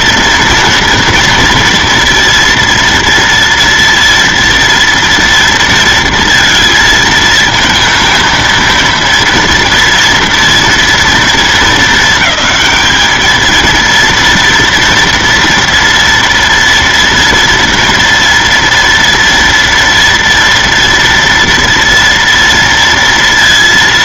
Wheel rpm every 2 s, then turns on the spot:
230, 230, 230, 230, 230, 230, 220, 230, 230, 230, 230, 230.
none